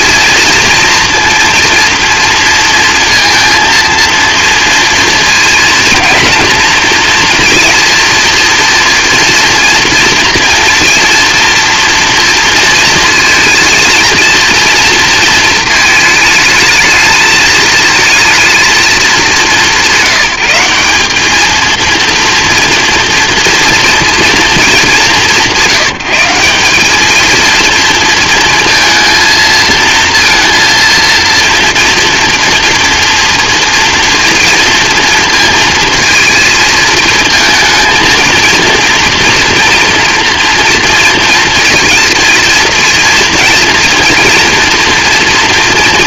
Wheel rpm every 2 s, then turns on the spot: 230, 230, 230, 230, 230, 240, 230, 230, 220, 220, 190, 230, 210, 210, 230, 230, 230, 230, 220, 230, 230, 230, 230.
none